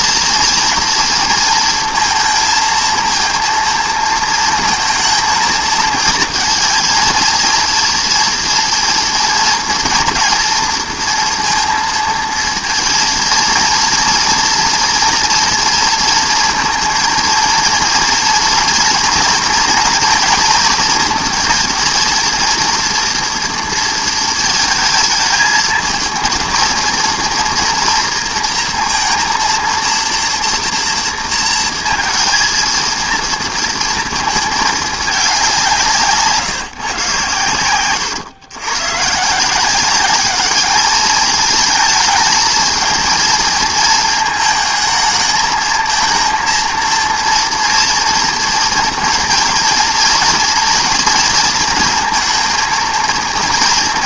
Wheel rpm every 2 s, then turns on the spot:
230, 230, 230, 230, 230, 230, 230, 230, 230, 230, 230, 230, 230, 230, 230, 230, 230, 230, 170, 120, 200, 220, 220, 230, 230, 230, 240.
none